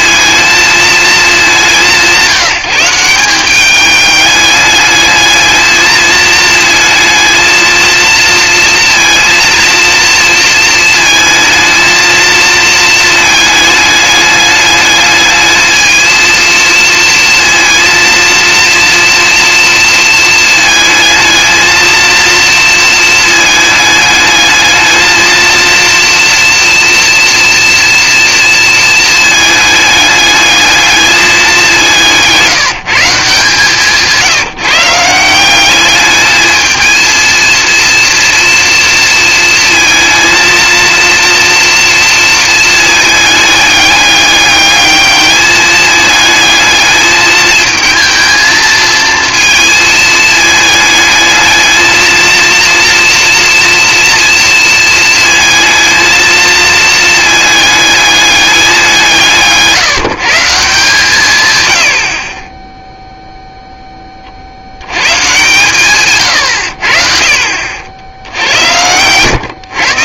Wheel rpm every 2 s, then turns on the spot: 220, 180, 210, 220, 230, 220, 220, 210, 230, 230, 220, 230, 220, 240, 230, 210, 170, 170, 220, 230, 230, 220, 210, 220, 230, 220, 230, 230, 220, 180, 160, 10, 80, 80, 100.
none